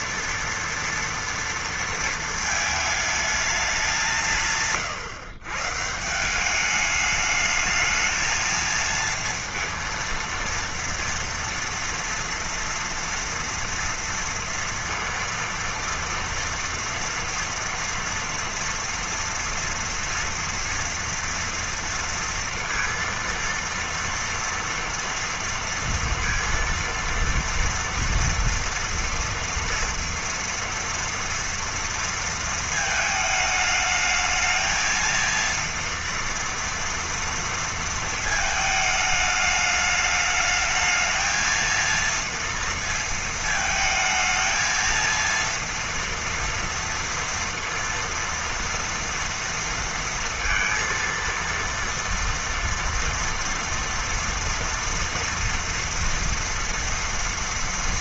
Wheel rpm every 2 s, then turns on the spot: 230, 220, 150, 200, 220, 230, 230, 230, 230, 230, 230, 230, 240, 230, 230, 230, 220, 220, 230, 220, 210, 230, 220, 230, 230, 230, 230, 230, 230.
none